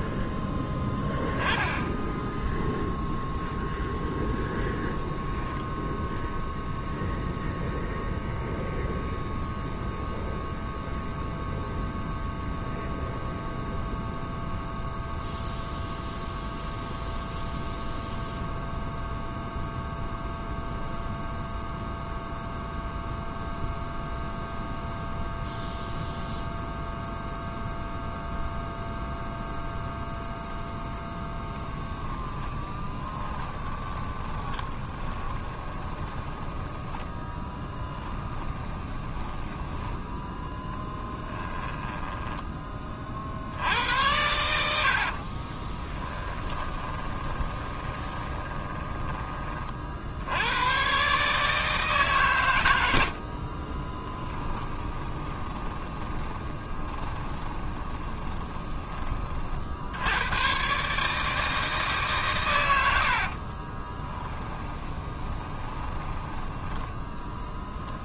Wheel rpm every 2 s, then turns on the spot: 10, 0, 0, 0, 0, 0, 0, 0, 0, 0, 0, 0, 0, 0, 0, 10, 30, 20, 10, 20, 10, 30, 60, 20, 20, 130, 70, 20, 30, 20, 140, 90, 20, 20.
30-36 38-42 44-50 54-58 64-66